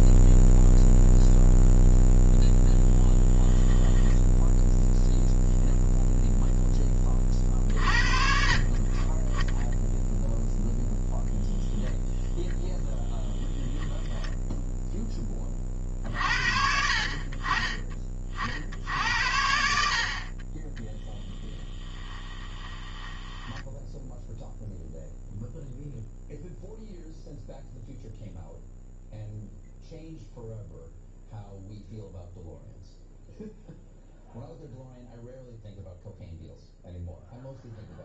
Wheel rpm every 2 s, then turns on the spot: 0, 10, 0, 10, 40, 0, 0, 10, 60, 70, 20, 10, 0, 0, 0, 0, 0, 0, 0.
22-24